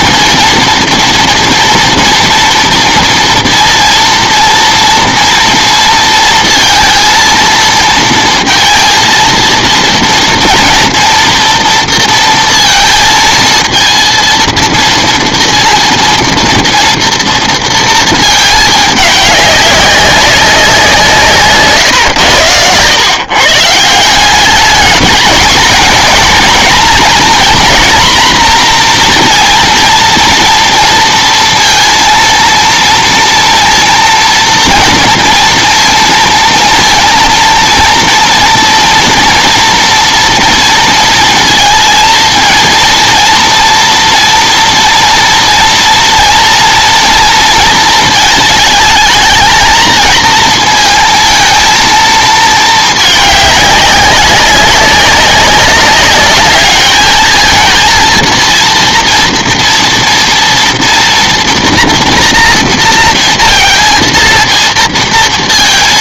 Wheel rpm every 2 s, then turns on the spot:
230, 230, 230, 230, 230, 240, 230, 230, 230, 220, 190, 110, 200, 240, 240, 230, 230, 230, 230, 230, 230, 230, 230, 230, 220, 230, 220, 200, 210, 230, 230, 230, 230.
none